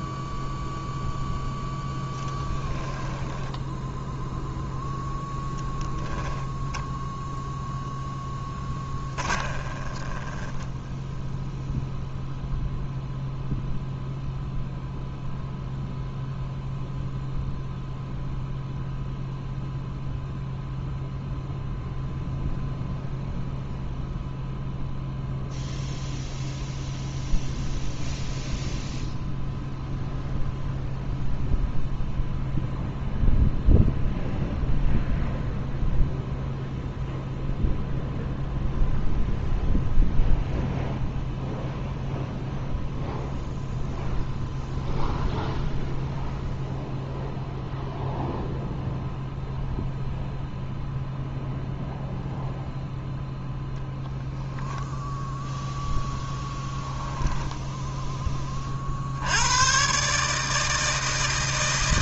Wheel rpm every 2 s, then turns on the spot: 0, 10, 0, 0, 20, 10, 0, 0, 0, 0, 0, 0, 0, 0, 0, 0, 0, 0, 0, 0, 0, 0, 0, 0, 0, 0, 0, 0, 10, 60, 160.
8-12 56-58